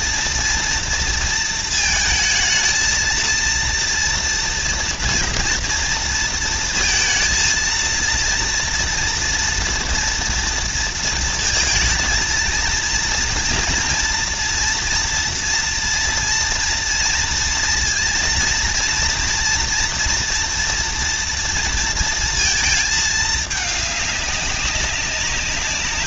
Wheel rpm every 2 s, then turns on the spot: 230, 220, 230, 230, 230, 230, 230, 230, 230, 230, 240, 220, 200.
none